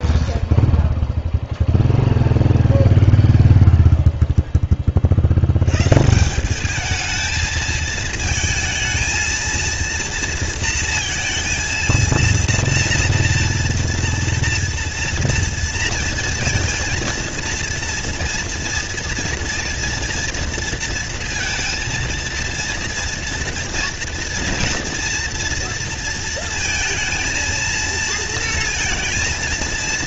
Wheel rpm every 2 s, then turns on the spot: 0, 0, 70, 220, 230, 230, 230, 230, 230, 240, 230, 230, 230, 230, 230.
none